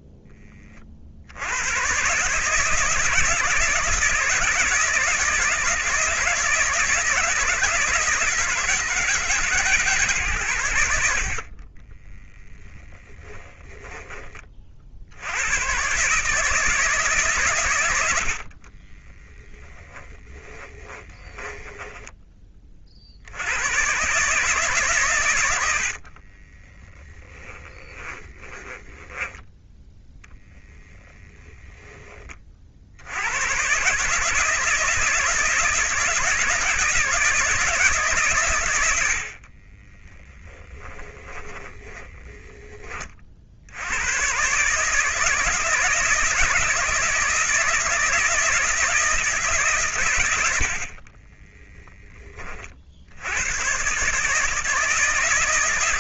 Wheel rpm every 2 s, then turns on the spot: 40, 160, 160, 160, 160, 80, 20, 60, 150, 10, 20, 50, 140, 10, 10, 10, 70, 160, 160, 100, 20, 20, 150, 160, 160, 50, 70, 160.
12-14 18-22 26-32 40-42